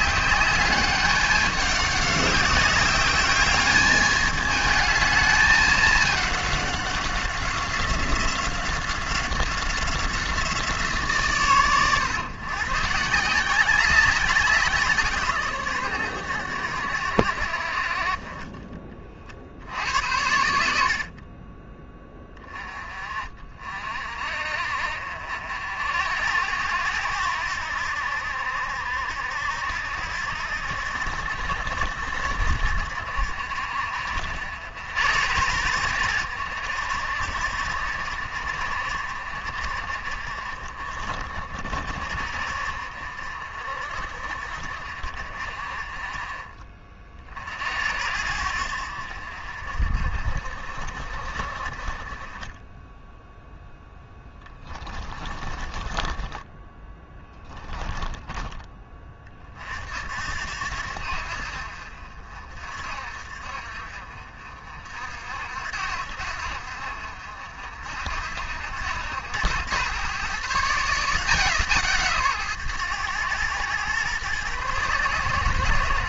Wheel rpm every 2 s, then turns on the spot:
200, 190, 220, 200, 190, 170, 140, 180, 100, 30, 80, 20, 50, 90, 70, 80, 70, 80, 80, 60, 40, 50, 50, 40, 70, 50, 20, 20, 20, 20, 70, 50, 50, 70, 80, 150, 130, 120.
54-58